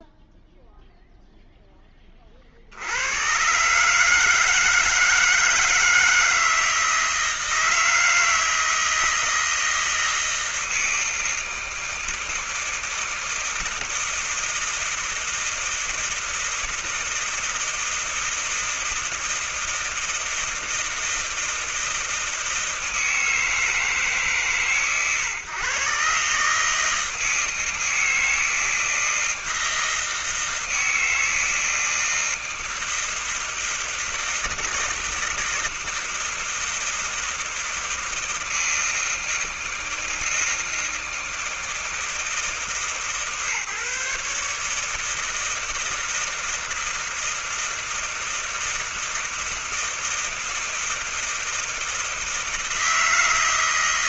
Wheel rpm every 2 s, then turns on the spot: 0, 20, 150, 160, 160, 160, 160, 160, 160, 160, 160, 160, 150, 130, 160, 160, 160, 160, 160, 160, 160, 160, 150, 160, 160, 160, 160.
none